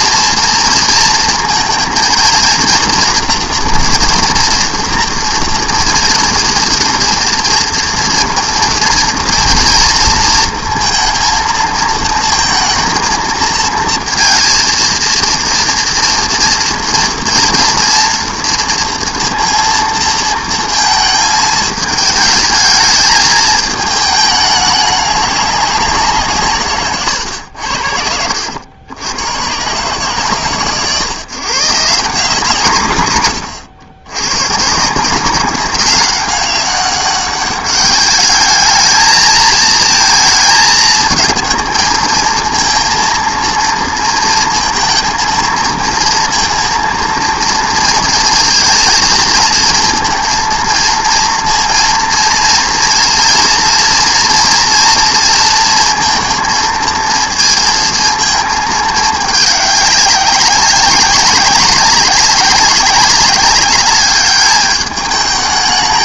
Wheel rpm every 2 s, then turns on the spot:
230, 230, 230, 230, 240, 230, 230, 230, 230, 230, 220, 220, 210, 130, 90, 130, 150, 160, 200, 220, 220, 230, 230, 230, 230, 230, 230, 230, 230, 210, 190, 190, 210.
none